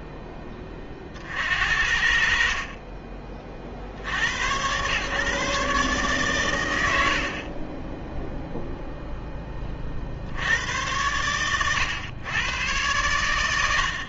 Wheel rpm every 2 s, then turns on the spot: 20, 30, 110, 80, 0, 100, 110.
2-4